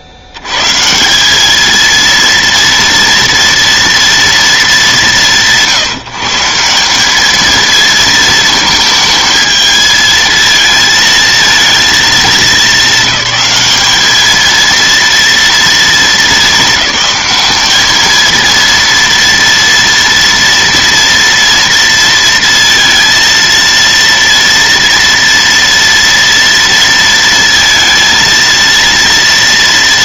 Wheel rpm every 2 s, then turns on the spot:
90, 230, 190, 180, 220, 230, 200, 220, 210, 230, 240, 230, 230, 230, 230.
none